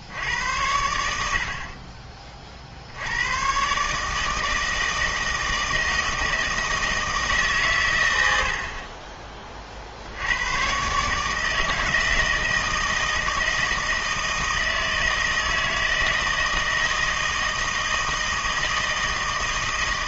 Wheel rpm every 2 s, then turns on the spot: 80, 60, 160, 160, 50, 130, 160, 160, 160, 160.
none